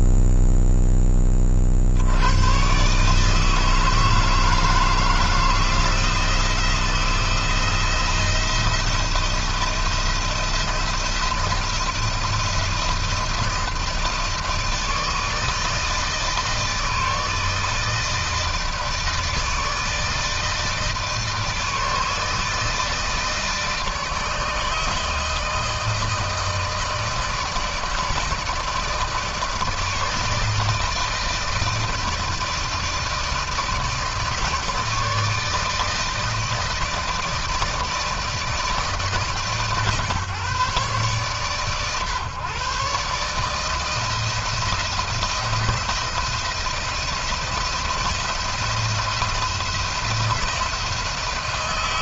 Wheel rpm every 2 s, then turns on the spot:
40, 160, 160, 170, 170, 160, 160, 160, 160, 160, 160, 160, 160, 160, 150, 160, 160, 160, 160, 150, 140, 150, 170, 170, 170, 160.
none